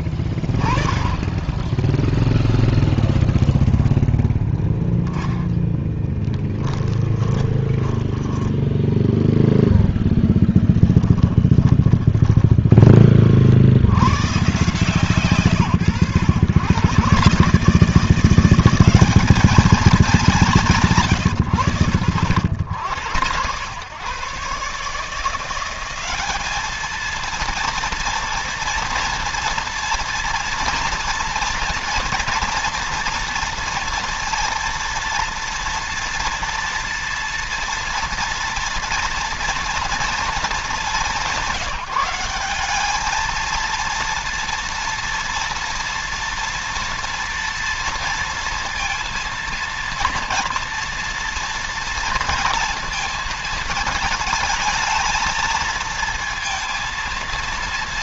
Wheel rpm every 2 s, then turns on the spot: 10, 0, 10, 10, 10, 10, 40, 140, 110, 200, 160, 100, 150, 220, 230, 230, 230, 230, 230, 230, 210, 210, 230, 230, 230, 230, 230, 220, 230.
6-12